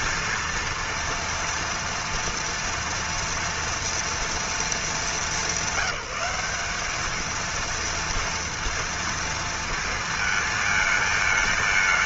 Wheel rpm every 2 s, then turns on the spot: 230, 230, 220, 210, 230, 220.
none